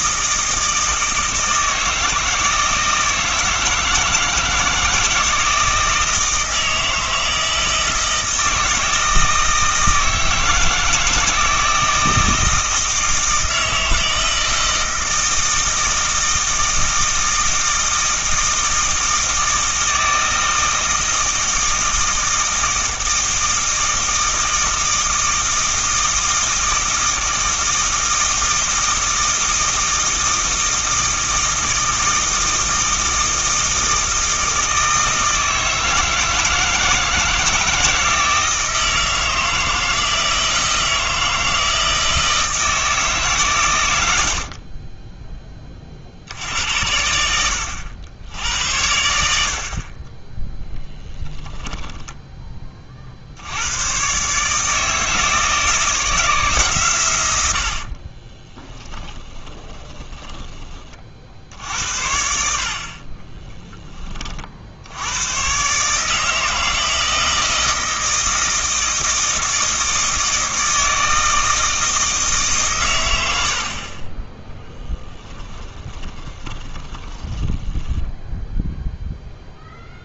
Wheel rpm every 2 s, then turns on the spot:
160, 160, 160, 160, 160, 160, 160, 160, 160, 160, 160, 160, 160, 160, 160, 160, 160, 160, 160, 160, 160, 160, 20, 90, 80, 0, 40, 160, 120, 10, 40, 40, 90, 160, 160, 160, 110, 10, 20, 0.
58-60 74-78